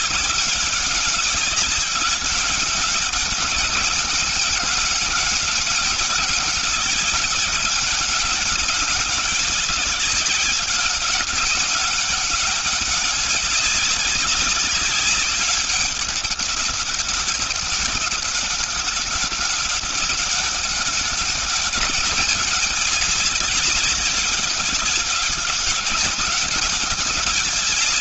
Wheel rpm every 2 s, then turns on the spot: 200, 200, 200, 200, 200, 190, 200, 190, 200, 200, 200, 210, 200, 200.
none